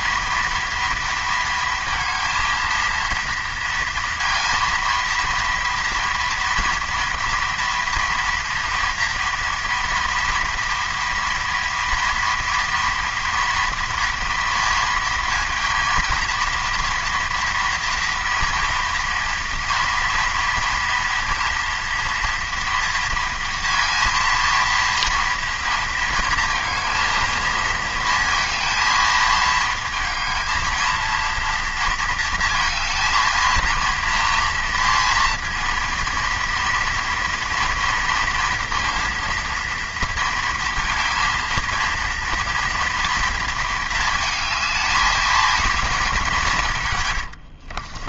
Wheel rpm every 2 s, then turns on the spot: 230, 230, 230, 230, 230, 230, 230, 220, 230, 230, 230, 230, 230, 230, 220, 230, 230, 230, 230, 230, 230, 230, 220, 90.
46-48